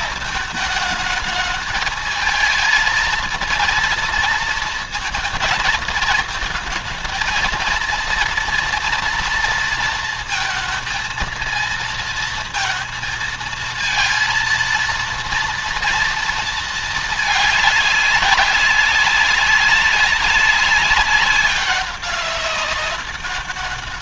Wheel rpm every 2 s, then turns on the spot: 220, 230, 230, 220, 230, 220, 230, 230, 220, 190, 190, 200.
none